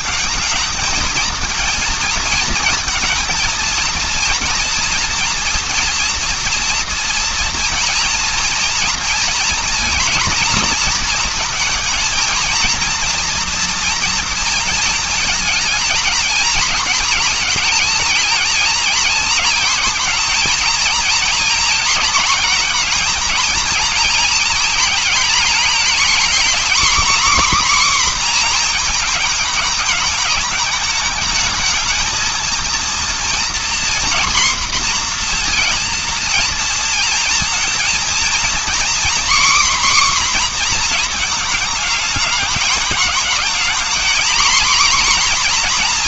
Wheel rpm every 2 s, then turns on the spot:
220, 230, 230, 240, 230, 230, 230, 230, 230, 230, 230, 230, 230, 260, 240, 220, 230, 240, 230, 250, 250, 220, 240.
none